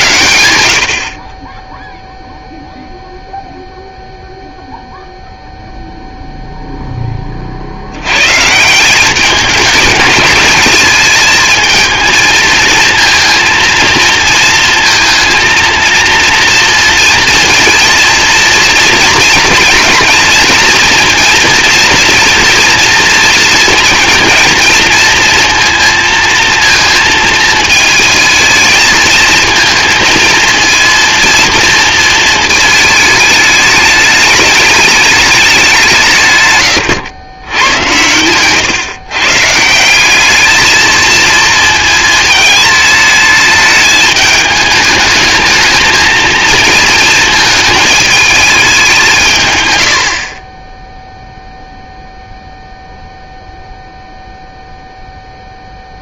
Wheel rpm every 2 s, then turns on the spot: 70, 0, 0, 0, 170, 220, 230, 230, 230, 230, 240, 240, 230, 220, 220, 230, 220, 210, 130, 130, 220, 210, 220, 230, 210, 20, 0, 0.
none